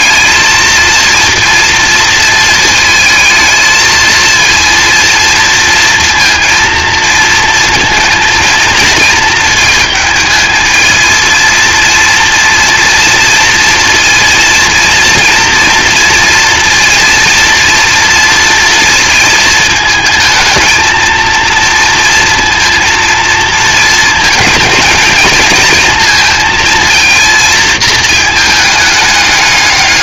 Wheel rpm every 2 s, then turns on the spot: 230, 230, 230, 230, 230, 220, 230, 230, 230, 230, 230, 230, 220, 230, 210.
none